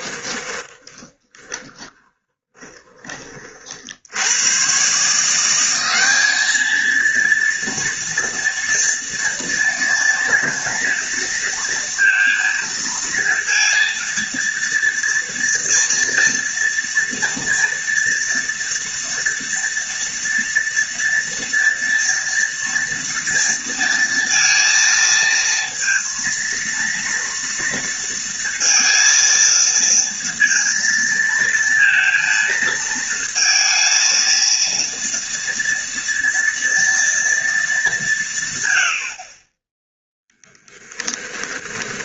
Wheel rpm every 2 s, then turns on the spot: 20, 20, 140, 230, 230, 230, 230, 230, 230, 230, 230, 230, 230, 230, 230, 230, 230, 230, 230, 90, 10.
0-2 40-42